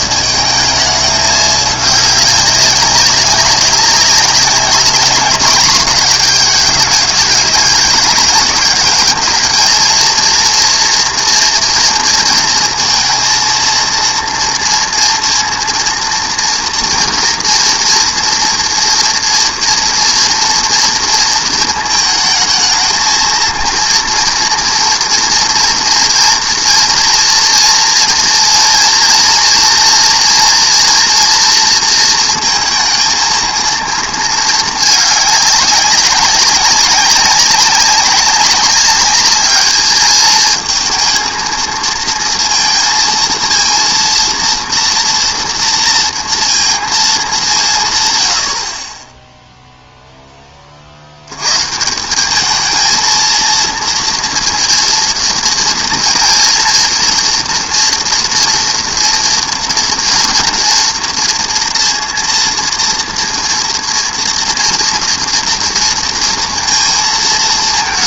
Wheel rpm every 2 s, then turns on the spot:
220, 200, 200, 210, 210, 230, 230, 230, 230, 230, 230, 220, 240, 230, 230, 230, 230, 220, 200, 200, 220, 230, 230, 230, 60, 30, 220, 230, 230, 230, 230, 230, 230, 230.
none